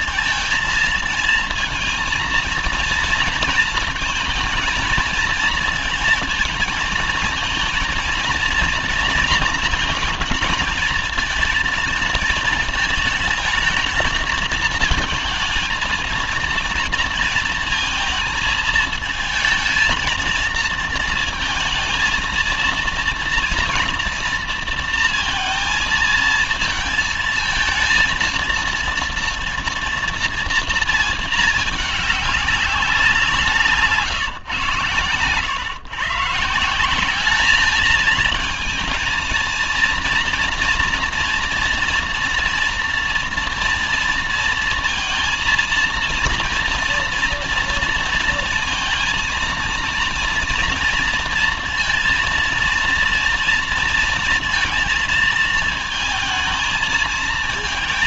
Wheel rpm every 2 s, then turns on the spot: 230, 230, 230, 220, 230, 220, 220, 220, 230, 220, 230, 220, 230, 220, 230, 230, 200, 140, 160, 220, 230, 240, 230, 230, 230, 230, 230, 230, 220.
none